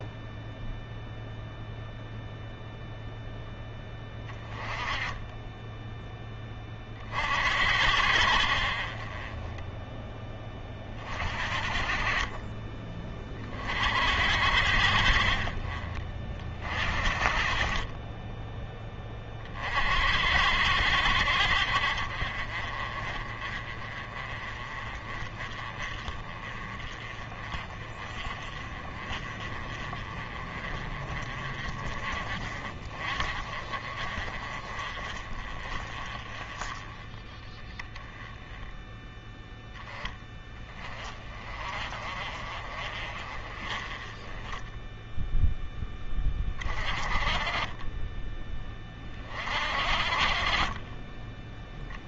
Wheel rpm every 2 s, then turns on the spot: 0, 0, 20, 40, 50, 30, 20, 60, 40, 10, 70, 40, 30, 30, 30, 30, 30, 30, 20, 10, 20, 40, 10, 30, 20, 20.
44-46